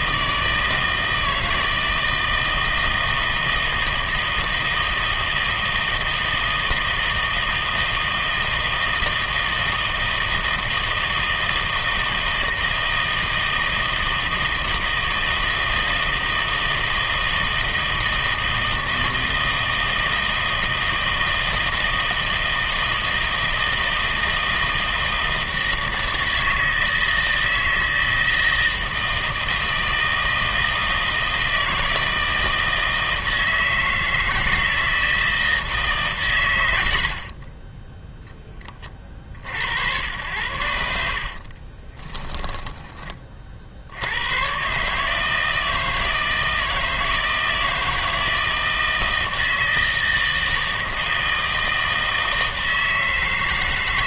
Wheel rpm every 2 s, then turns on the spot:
160, 160, 160, 160, 160, 160, 160, 160, 160, 160, 160, 160, 160, 160, 160, 160, 160, 160, 90, 30, 80, 20, 140, 160, 160, 160, 160.
none